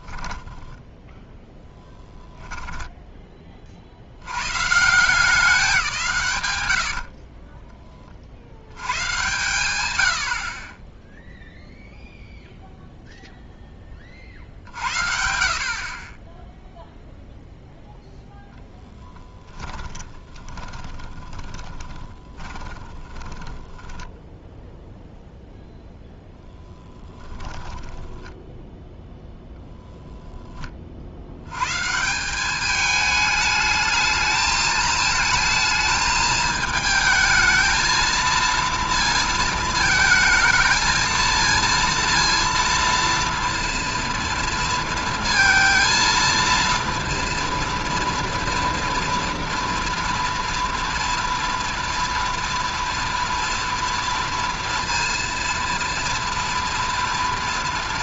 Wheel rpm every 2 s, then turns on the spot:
0, 30, 190, 20, 110, 0, 0, 50, 0, 10, 20, 20, 0, 10, 0, 50, 220, 220, 220, 230, 220, 230, 230, 230, 230, 230, 230, 230, 230.
6-8 18-24 26-28